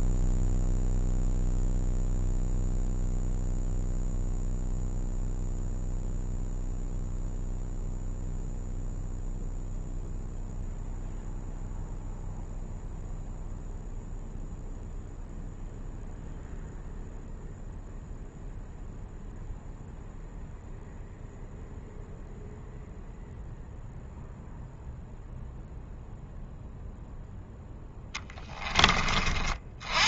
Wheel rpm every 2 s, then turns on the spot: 0, 0, 0, 0, 0, 0, 0, 0, 0, 0, 0, 0, 0, 0, 20.
28-30